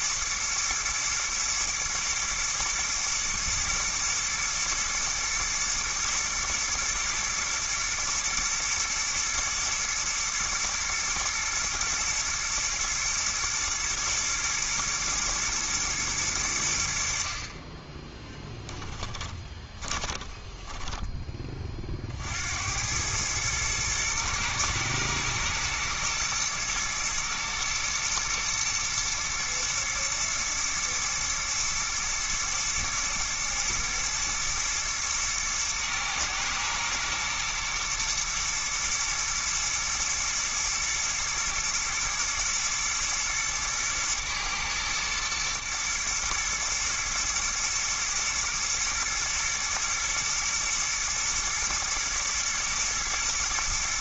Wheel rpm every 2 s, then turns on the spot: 110, 120, 120, 120, 110, 120, 120, 110, 90, 10, 10, 80, 110, 120, 120, 120, 110, 110, 110, 120, 110, 120, 110, 110, 120, 120, 110.
18-22